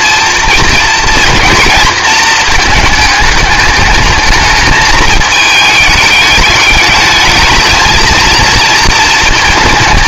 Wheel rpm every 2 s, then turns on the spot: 230, 220, 220, 210, 230.
none